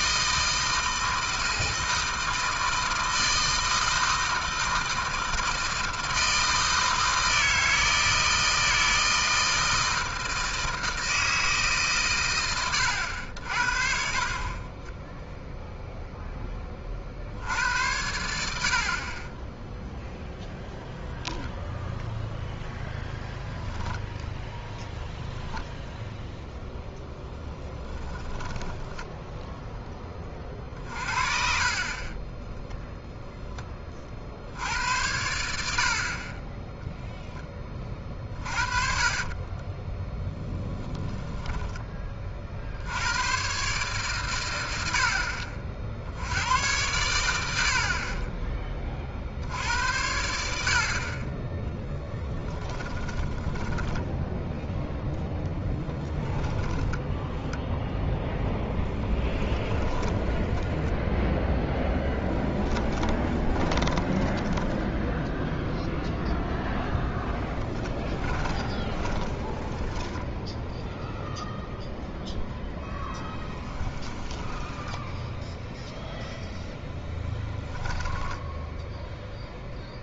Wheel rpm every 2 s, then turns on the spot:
160, 160, 160, 160, 160, 160, 120, 30, 20, 70, 0, 0, 0, 0, 10, 30, 0, 80, 20, 40, 10, 50, 80, 90, 20, 70, 20, 0, 10, 10, 0, 10, 10, 10, 20, 0, 0, 10, 0, 10.
28-30 38-40 52-54 56-60 62-66 68-70 74-76